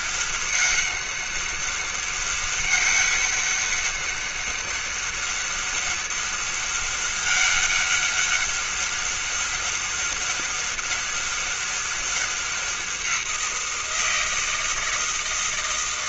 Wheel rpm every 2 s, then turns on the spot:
200, 200, 200, 200, 200, 200, 190, 160.
none